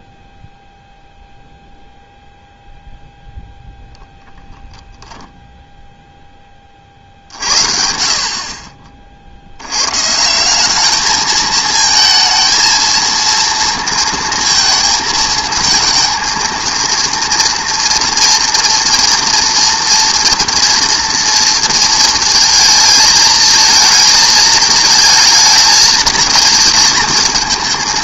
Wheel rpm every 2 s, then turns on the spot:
0, 0, 0, 20, 50, 190, 220, 230, 230, 240, 240, 220, 220, 220.
none